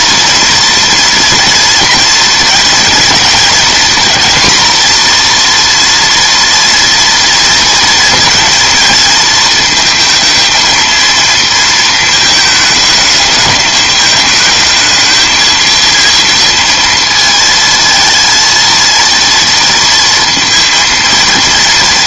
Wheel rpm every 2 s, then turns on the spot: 230, 230, 240, 230, 220, 230, 220, 220, 230, 230, 230.
none